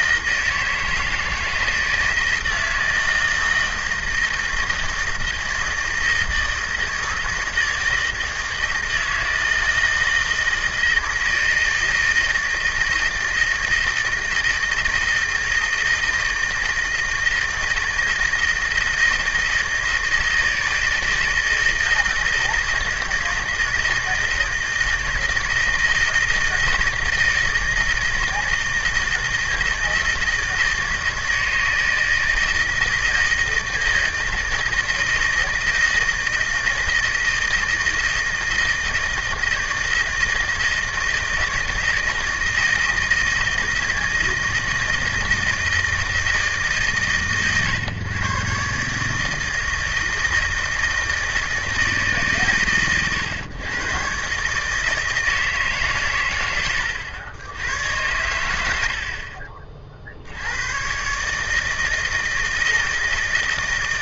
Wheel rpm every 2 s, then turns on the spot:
160, 160, 160, 160, 160, 160, 160, 160, 160, 160, 160, 160, 160, 160, 160, 160, 160, 160, 160, 160, 160, 160, 160, 130, 140, 160, 120, 160, 90, 70, 130, 160.
none